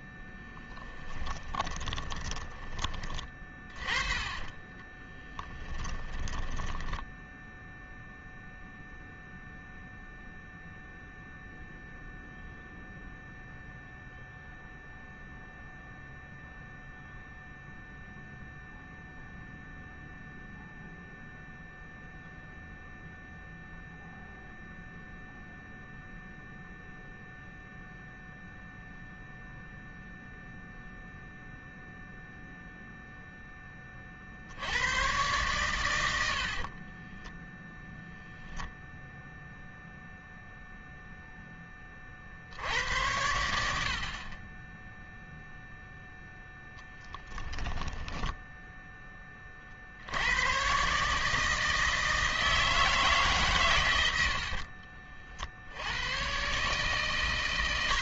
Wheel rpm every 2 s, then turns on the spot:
10, 20, 30, 10, 0, 0, 0, 0, 0, 0, 0, 0, 0, 0, 0, 0, 0, 100, 30, 0, 0, 80, 10, 10, 10, 130, 160, 50, 140.
0-2 4-8 36-38 46-48 54-56